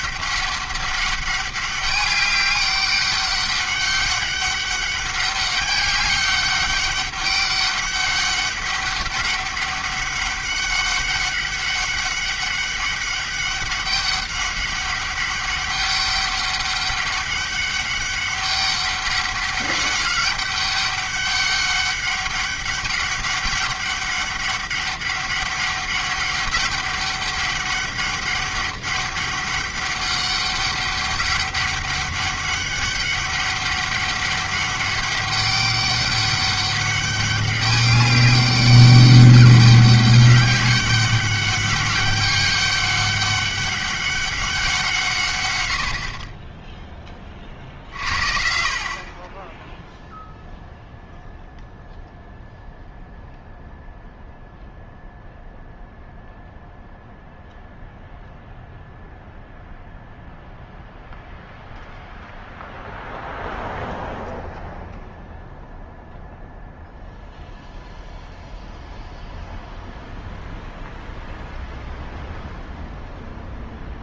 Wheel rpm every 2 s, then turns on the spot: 200, 200, 200, 200, 200, 200, 200, 200, 200, 200, 200, 200, 200, 200, 200, 200, 200, 200, 200, 200, 200, 200, 180, 10, 40, 0, 0, 0, 0, 0, 0, 0, 0, 0, 0, 0, 0.
none